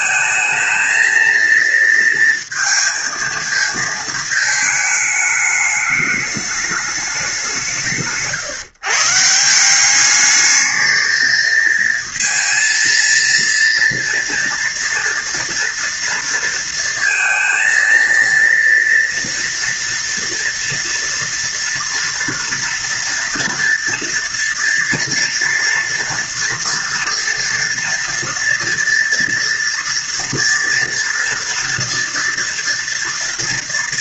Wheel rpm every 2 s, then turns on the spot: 220, 230, 220, 210, 150, 220, 230, 230, 230, 230, 230, 230, 230, 230, 240, 230, 230.
none